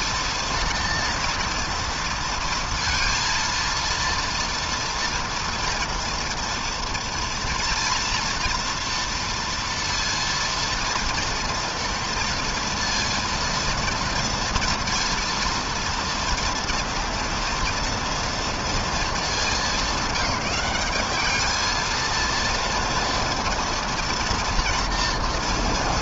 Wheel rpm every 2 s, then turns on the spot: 230, 230, 230, 230, 230, 230, 230, 230, 230, 230, 190, 230, 230.
none